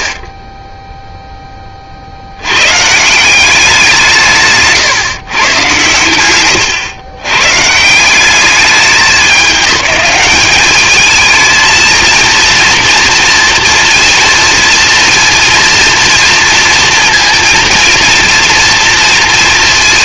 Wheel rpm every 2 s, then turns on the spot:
10, 120, 150, 120, 200, 210, 230, 230, 230, 230.
none